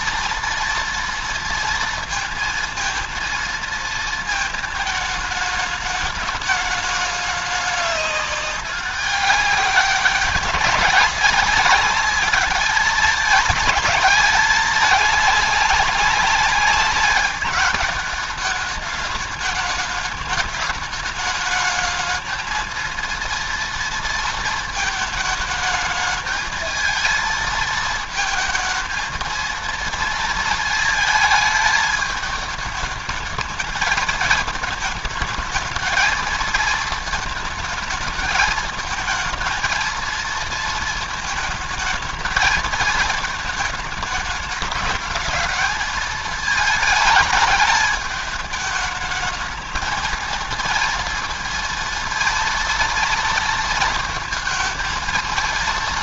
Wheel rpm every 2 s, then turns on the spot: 230, 230, 220, 210, 200, 190, 210, 210, 200, 210, 210, 220, 220, 220, 220, 230, 210, 210, 220, 220, 230, 220, 220, 220, 220, 230, 230, 230.
none